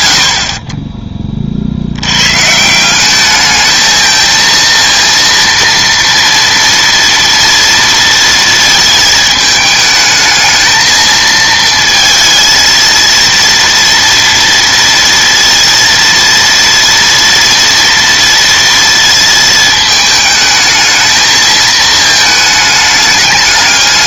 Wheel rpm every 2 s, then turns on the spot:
80, 170, 230, 230, 220, 220, 230, 230, 230, 230, 220, 210.
none